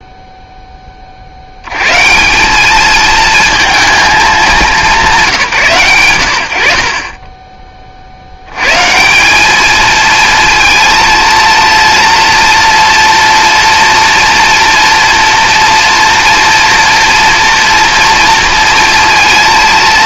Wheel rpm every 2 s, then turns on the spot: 20, 210, 190, 50, 140, 230, 230, 240, 230, 230.
none